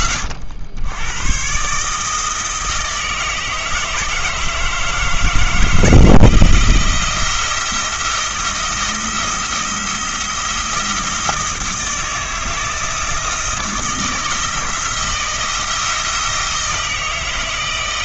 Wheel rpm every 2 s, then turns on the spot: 80, 160, 160, 170, 170, 170, 160, 160, 160.
none